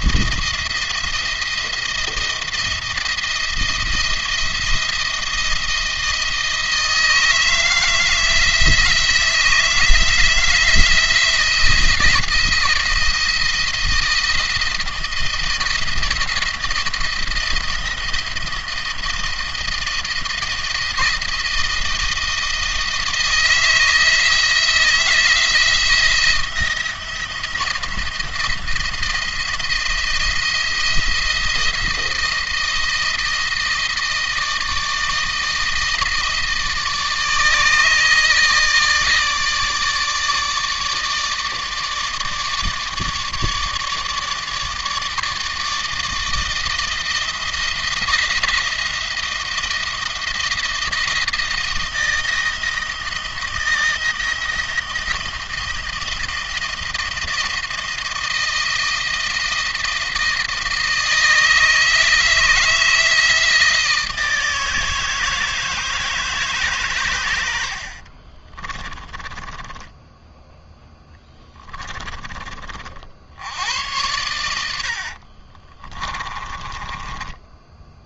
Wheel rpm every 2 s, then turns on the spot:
170, 170, 170, 160, 170, 170, 170, 170, 170, 160, 170, 160, 160, 170, 170, 170, 170, 160, 160, 160, 150, 160, 150, 160, 170, 170, 170, 170, 160, 160, 160, 160, 160, 130, 30, 10, 40, 80, 20.
68-70 74-78